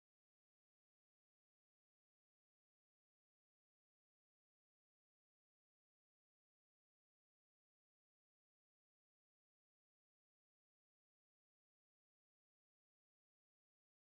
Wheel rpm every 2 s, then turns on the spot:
0, 0, 0, 0, 0, 0, 0.
none